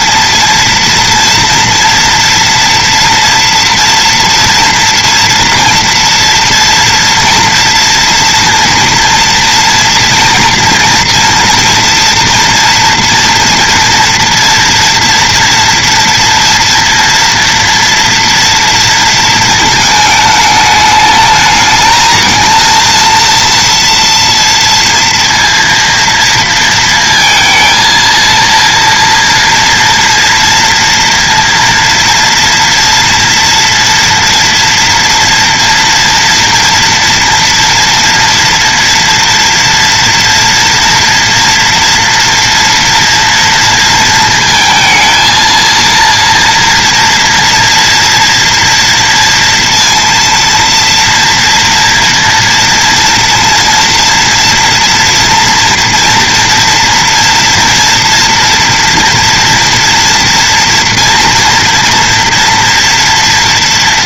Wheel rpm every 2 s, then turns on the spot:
230, 230, 230, 230, 230, 230, 230, 230, 230, 230, 210, 230, 230, 230, 230, 230, 230, 230, 240, 230, 230, 230, 230, 230, 230, 230, 230, 230, 230, 230, 230, 230.
none